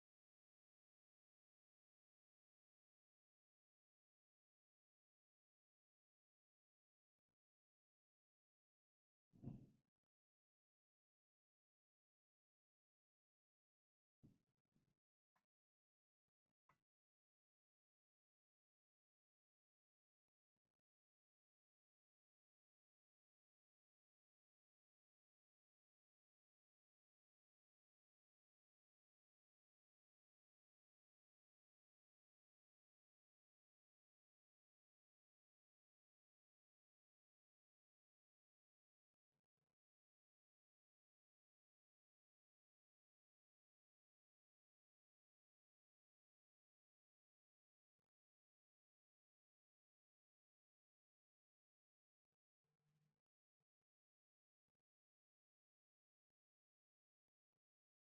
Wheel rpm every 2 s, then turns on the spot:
0, 0, 0, 0, 0, 0, 0, 0, 0, 0, 0, 0, 0, 0, 0, 0, 0, 0, 0, 0, 0, 0, 0, 0, 0, 0, 0, 0, 0.
none